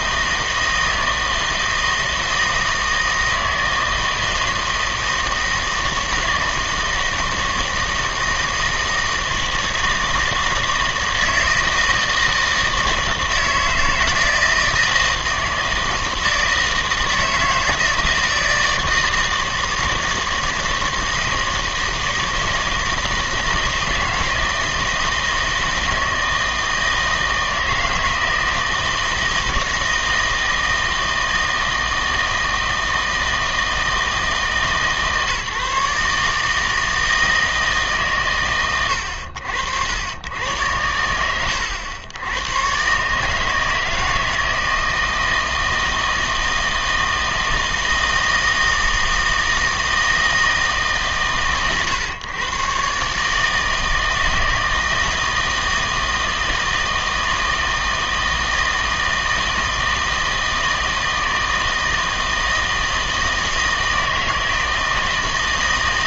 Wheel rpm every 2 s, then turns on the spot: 160, 160, 160, 160, 160, 160, 160, 160, 160, 160, 160, 160, 160, 160, 160, 160, 160, 160, 160, 120, 100, 120, 160, 160, 160, 150, 130, 160, 160, 160, 160, 160, 160.
none